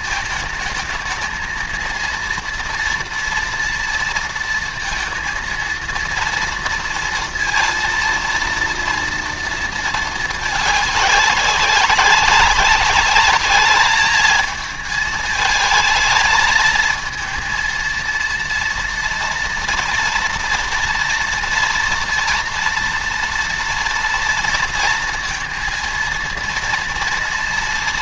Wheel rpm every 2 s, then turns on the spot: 220, 230, 230, 230, 230, 200, 200, 220, 230, 230, 230, 230, 230, 230.
none